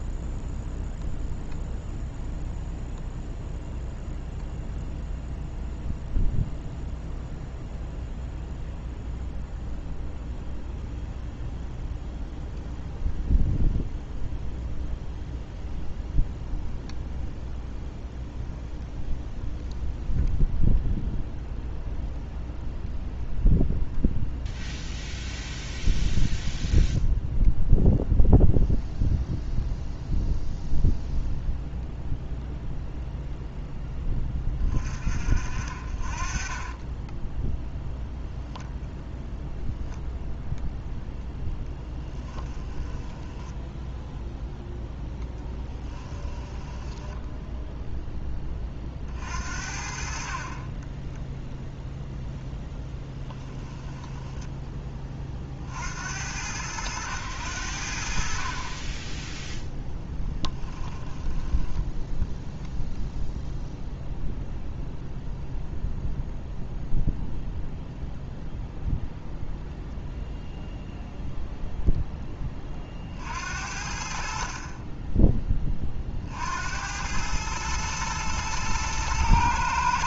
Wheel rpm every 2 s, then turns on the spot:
0, 0, 0, 0, 0, 0, 0, 0, 0, 0, 0, 0, 0, 0, 0, 0, 0, 30, 10, 0, 0, 10, 0, 10, 30, 20, 0, 20, 90, 20, 10, 0, 0, 0, 0, 0, 40, 30, 90, 110.
36-38 42-44 46-48 50-52 60-62